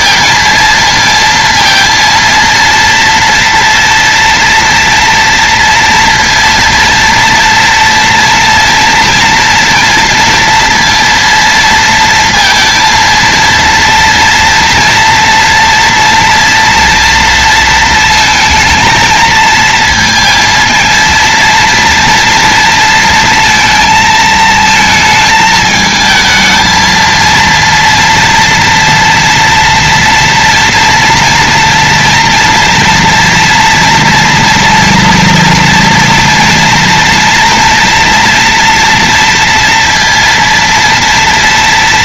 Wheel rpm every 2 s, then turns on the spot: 230, 230, 230, 230, 230, 230, 230, 230, 230, 230, 230, 230, 220, 230, 240, 230, 230, 230, 240, 230, 230.
none